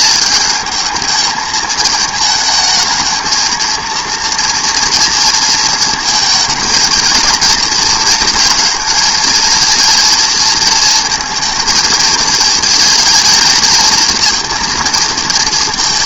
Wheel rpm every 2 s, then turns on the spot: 220, 220, 230, 220, 230, 230, 230, 230.
none